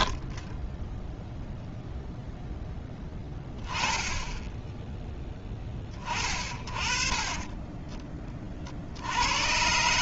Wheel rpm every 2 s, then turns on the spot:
80, 0, 0, 20, 10.
none